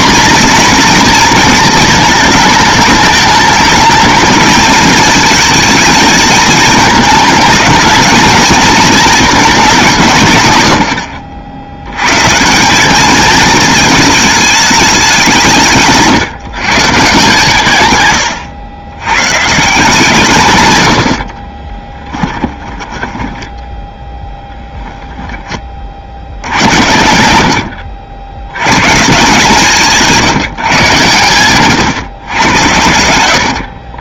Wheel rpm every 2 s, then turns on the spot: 240, 210, 220, 220, 220, 90, 190, 210, 160, 100, 120, 20, 0, 100, 120, 150, 100.
22-24